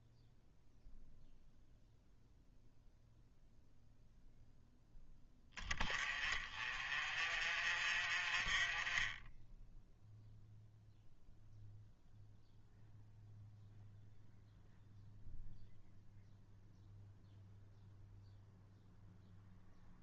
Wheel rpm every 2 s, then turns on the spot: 0, 0, 0, 30, 20, 0, 0, 0, 0, 0.
none